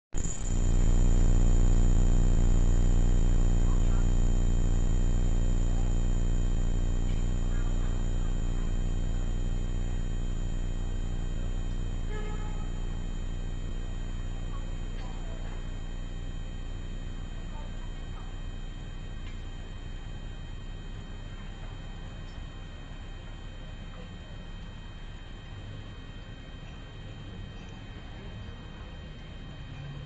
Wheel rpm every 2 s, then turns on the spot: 0, 0, 0, 0, 0, 0, 0, 0, 0, 0, 0, 0, 0, 0, 0.
none